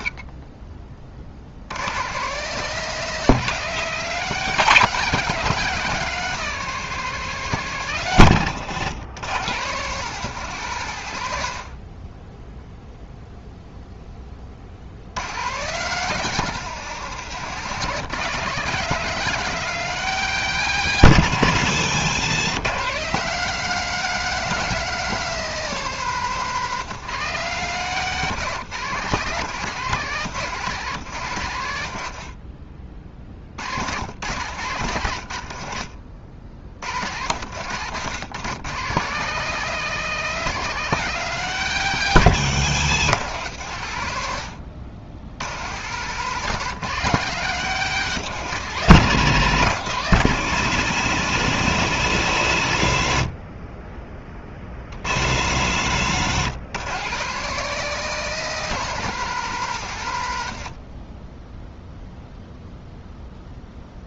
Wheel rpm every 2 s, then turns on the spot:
40, 170, 190, 190, 130, 140, 0, 60, 170, 170, 180, 160, 190, 170, 160, 150, 40, 110, 70, 140, 190, 150, 90, 180, 160, 130, 90, 50, 130, 190, 80, 0.
42-44 60-62